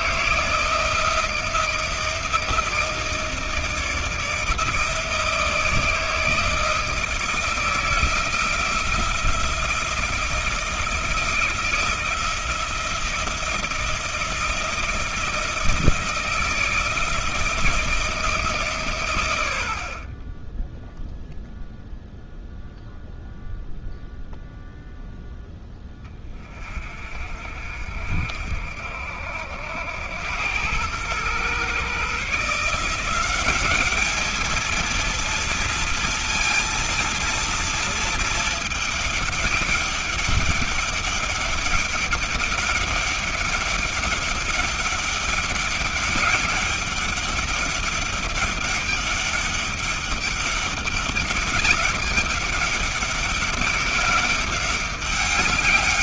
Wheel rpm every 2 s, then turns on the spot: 170, 160, 160, 160, 170, 170, 170, 170, 160, 150, 20, 0, 0, 30, 60, 100, 150, 220, 230, 220, 200, 200, 200, 200, 200, 200, 200, 200.
none